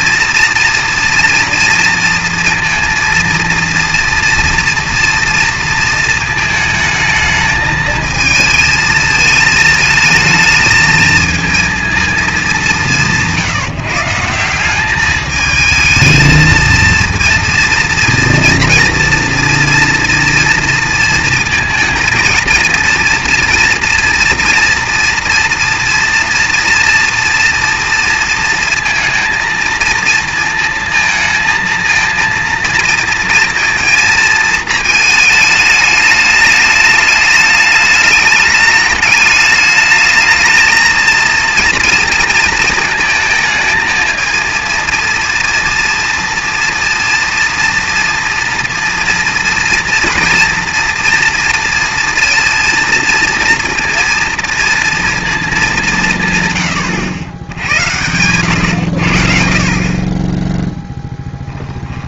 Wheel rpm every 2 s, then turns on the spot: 240, 230, 230, 220, 220, 220, 210, 190, 230, 230, 230, 230, 230, 230, 230, 220, 220, 220, 210, 210, 220, 230, 230, 230, 230, 240, 230, 230, 130, 100, 10.
none